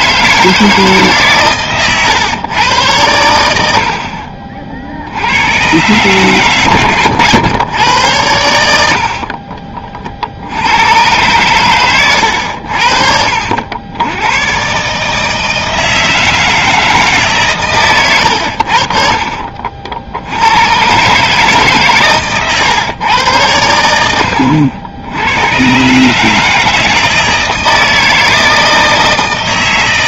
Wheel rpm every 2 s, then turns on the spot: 160, 110, 40, 120, 90, 80, 80, 120, 160, 100, 90, 130, 80, 160, 160.
18-20